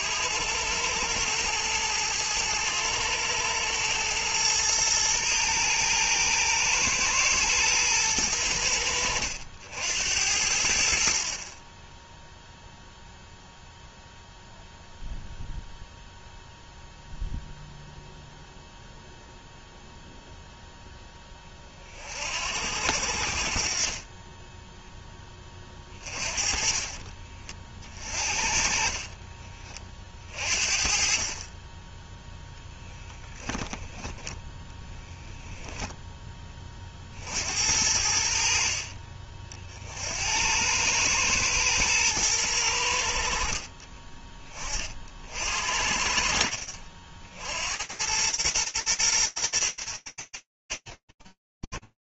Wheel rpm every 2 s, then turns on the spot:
100, 100, 110, 110, 90, 70, 0, 0, 0, 0, 0, 60, 10, 30, 50, 50, 0, 10, 20, 60, 100, 90, 30, 60, 110, 60.
26-30